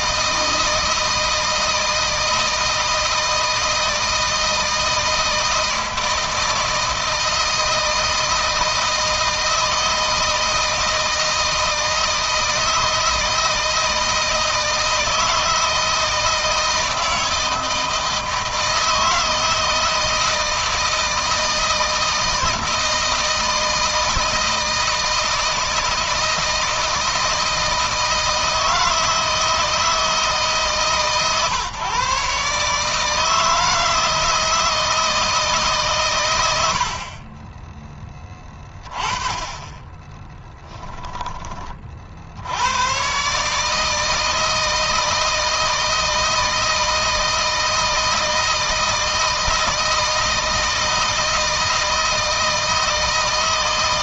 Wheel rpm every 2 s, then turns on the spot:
160, 160, 160, 160, 160, 160, 160, 160, 160, 160, 160, 160, 160, 160, 160, 140, 150, 160, 60, 20, 10, 110, 160, 160, 160, 160, 160.
none